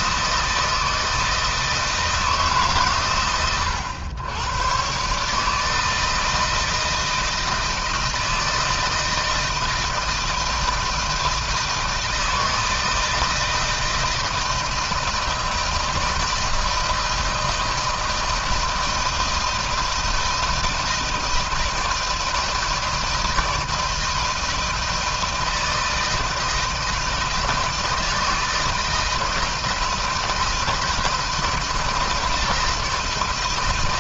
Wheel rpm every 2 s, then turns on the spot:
160, 140, 130, 160, 160, 160, 160, 160, 160, 160, 160, 160, 160, 160, 160, 160, 160.
none